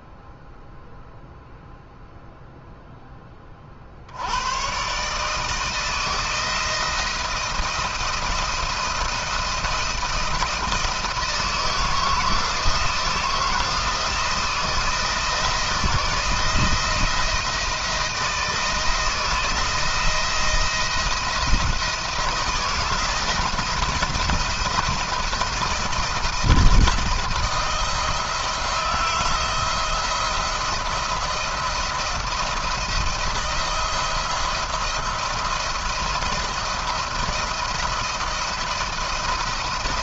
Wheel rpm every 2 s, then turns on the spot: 0, 0, 100, 170, 170, 170, 160, 160, 160, 160, 170, 170, 170, 170, 170, 170, 160, 170, 170, 170.
none